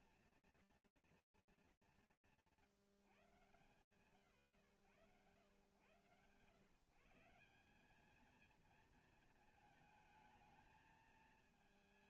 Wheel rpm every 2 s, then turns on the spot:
90, 110, 140, 230, 220, 200.
none